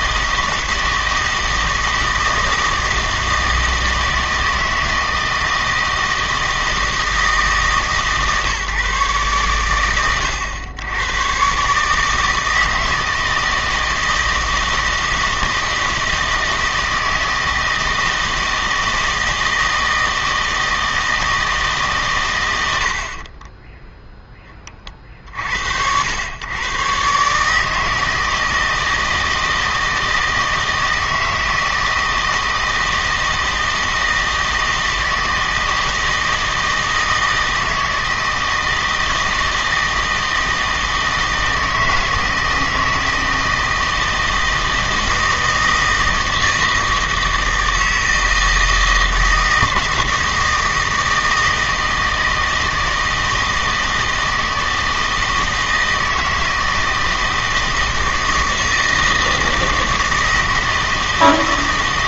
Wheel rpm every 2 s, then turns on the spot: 160, 160, 160, 160, 140, 100, 160, 160, 160, 160, 160, 80, 30, 120, 160, 160, 160, 160, 160, 160, 160, 160, 160, 160, 160, 160, 160, 160, 160, 160, 160.
none